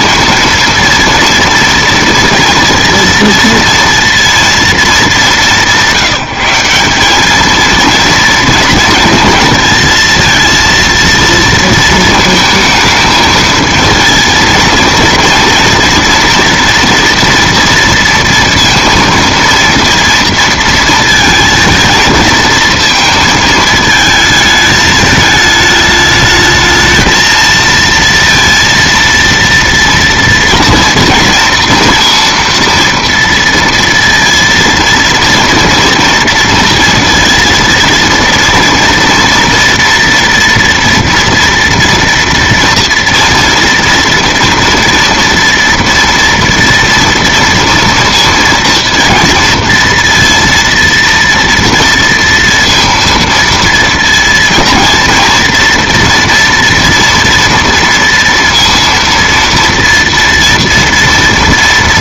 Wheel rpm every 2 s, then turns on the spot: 230, 230, 200, 200, 230, 230, 220, 230, 230, 230, 220, 220, 210, 220, 230, 230, 230, 230, 230, 230, 240, 230, 230, 230, 230, 230, 230, 230, 230, 230, 230.
none